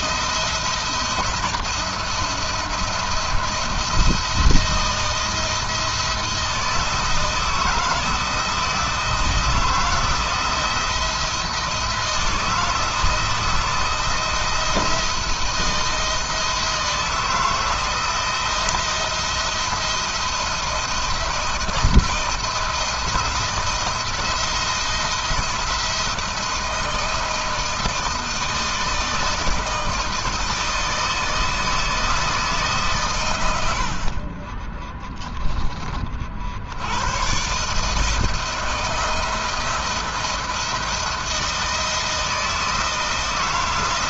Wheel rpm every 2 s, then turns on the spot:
170, 170, 160, 160, 160, 170, 160, 170, 160, 170, 170, 170, 170, 170, 160, 160, 120, 10, 100, 170, 160, 160.
none